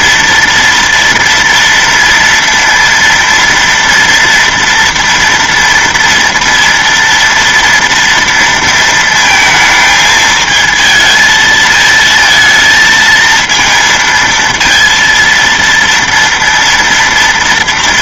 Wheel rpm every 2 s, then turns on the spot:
240, 230, 230, 230, 230, 220, 230, 230, 230.
none